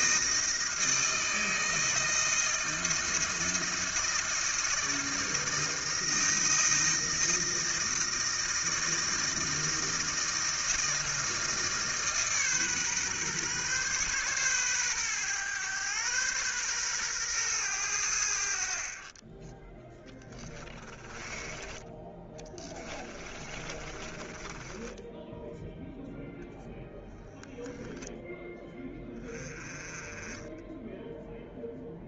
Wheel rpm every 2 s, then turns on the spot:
160, 170, 160, 160, 160, 160, 140, 120, 120, 40, 20, 30, 10, 0, 10, 10.
20-26